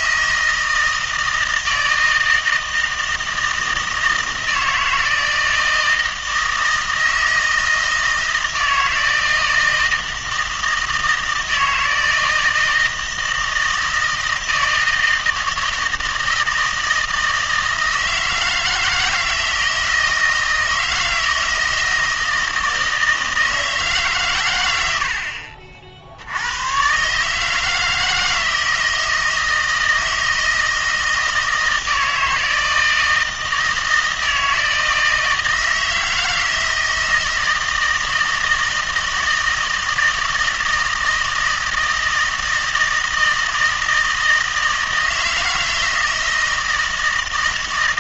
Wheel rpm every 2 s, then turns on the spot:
160, 160, 160, 160, 160, 160, 160, 160, 160, 160, 160, 160, 100, 120, 160, 160, 160, 160, 160, 160, 160, 160, 160, 160.
none